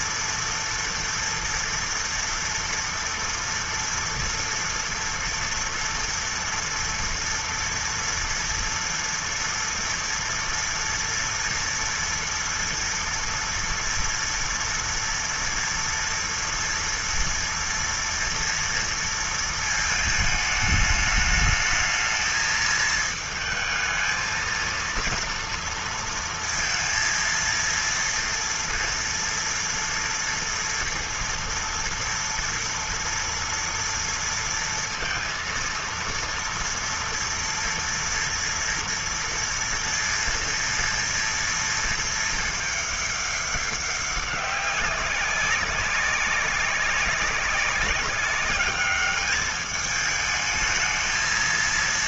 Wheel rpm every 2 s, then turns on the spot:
230, 230, 230, 230, 240, 230, 230, 230, 240, 230, 220, 220, 220, 230, 230, 230, 230, 230, 230, 230, 230, 220, 200, 190, 200, 210.
none